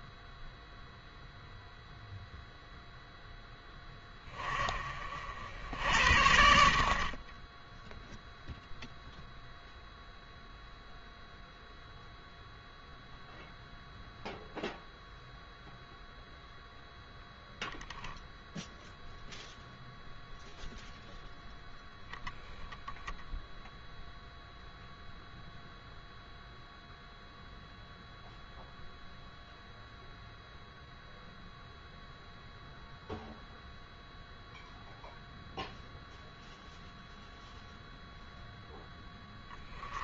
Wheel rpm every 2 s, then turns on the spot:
0, 20, 80, 0, 0, 0, 0, 0, 0, 0, 0, 0, 0, 0, 0, 0, 0, 0, 0, 20.
none